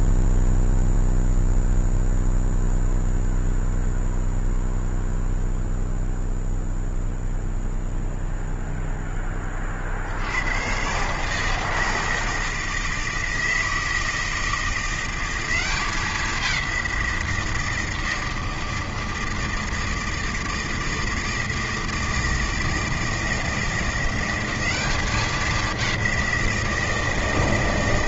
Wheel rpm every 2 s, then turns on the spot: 0, 0, 0, 0, 0, 110, 160, 170, 190, 160, 160, 160, 190, 170.
none